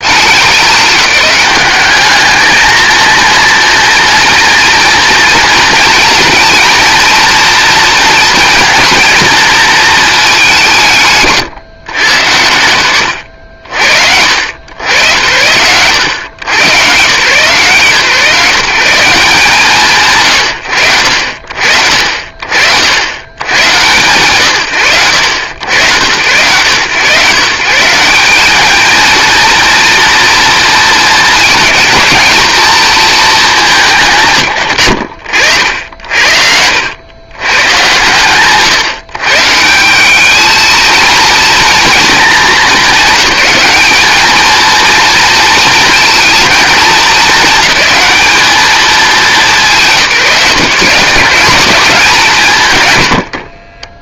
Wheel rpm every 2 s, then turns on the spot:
190, 220, 230, 230, 230, 200, 110, 70, 120, 150, 110, 60, 90, 110, 210, 230, 210, 150, 70, 100, 220, 220, 220, 220, 210, 150, 200.
36-38